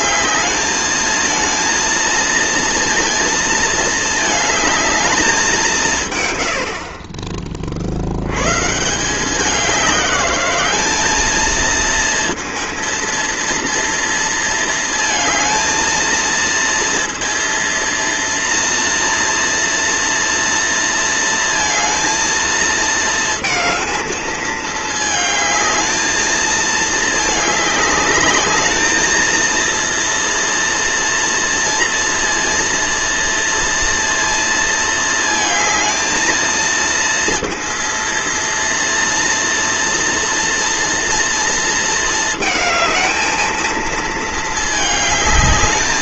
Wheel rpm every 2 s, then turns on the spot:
220, 230, 220, 80, 120, 200, 230, 230, 230, 230, 230, 230, 220, 220, 210, 230, 230, 230, 220, 230, 240, 220, 220.
none